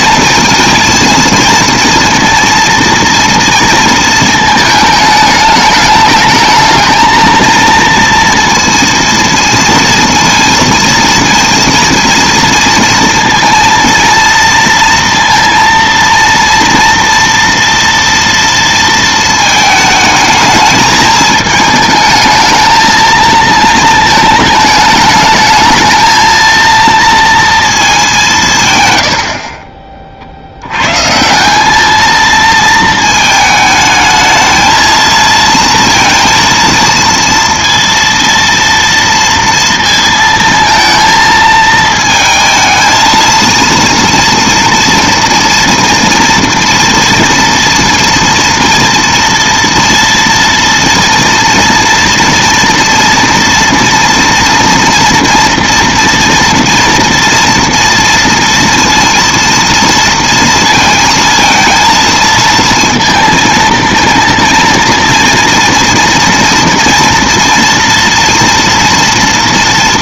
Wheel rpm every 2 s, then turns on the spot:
230, 230, 220, 220, 230, 230, 230, 230, 230, 230, 220, 220, 220, 230, 160, 70, 220, 220, 230, 230, 220, 220, 230, 230, 230, 230, 230, 230, 230, 230, 230, 230, 230, 230, 240.
none